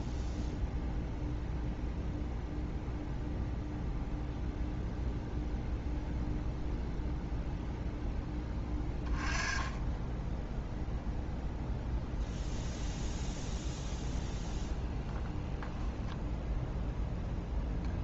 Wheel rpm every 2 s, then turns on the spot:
0, 0, 0, 0, 20, 0, 0, 0, 0.
none